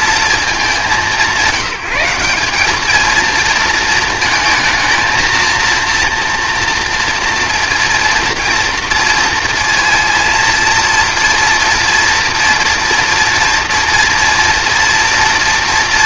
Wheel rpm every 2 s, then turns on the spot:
210, 210, 220, 240, 230, 230, 240, 230.
none